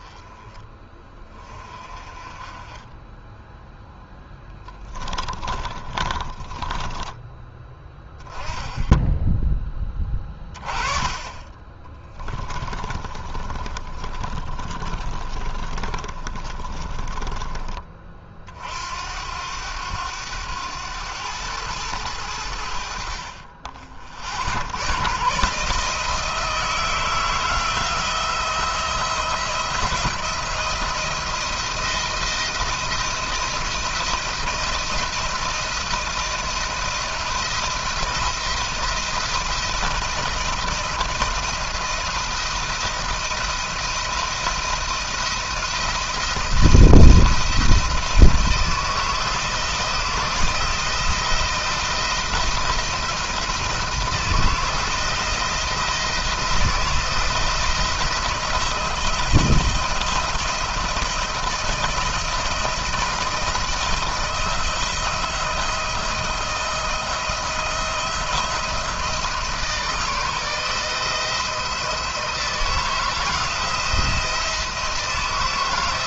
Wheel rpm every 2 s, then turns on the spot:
20, 20, 20, 20, 10, 20, 20, 30, 30, 60, 100, 70, 90, 160, 170, 170, 170, 170, 170, 170, 170, 170, 170, 170, 170, 170, 170, 160, 170, 170, 170, 170, 170, 170, 170, 160, 160, 160.
4-8 12-18